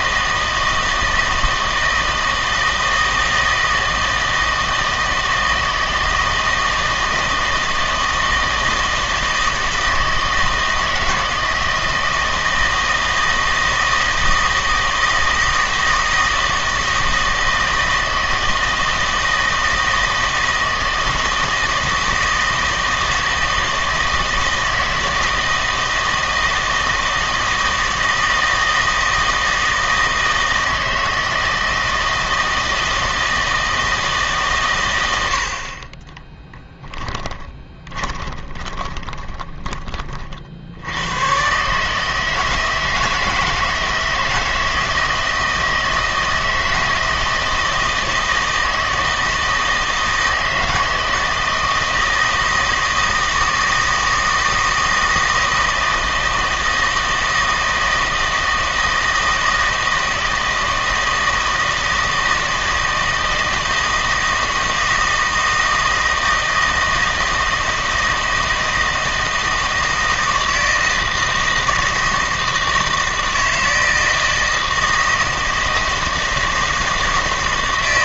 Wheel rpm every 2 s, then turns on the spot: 160, 160, 160, 160, 160, 160, 160, 160, 160, 160, 160, 160, 160, 160, 160, 160, 160, 110, 10, 20, 70, 160, 160, 160, 160, 160, 160, 160, 160, 160, 160, 160, 160, 160, 160, 160, 160, 160, 160.
36-40